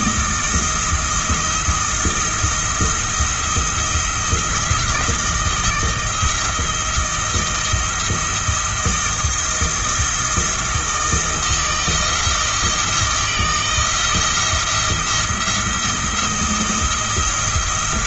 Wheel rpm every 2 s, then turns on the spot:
170, 170, 170, 160, 170, 170, 170, 170, 170.
none